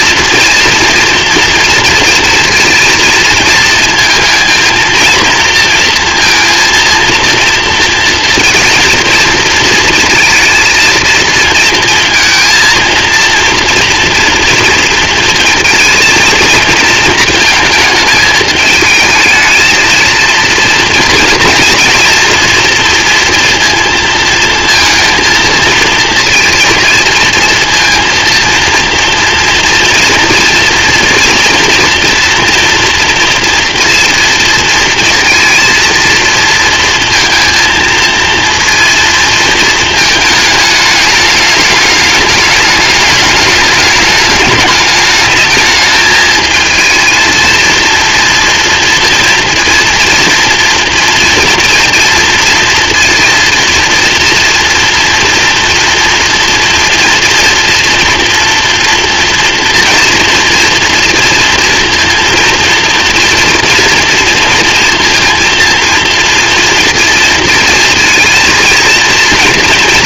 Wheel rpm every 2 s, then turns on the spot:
240, 220, 230, 230, 230, 230, 230, 230, 220, 220, 230, 230, 230, 230, 230, 240, 230, 230, 230, 230, 210, 210, 210, 220, 230, 230, 230, 240, 230, 230, 230, 230, 230, 230, 230.
none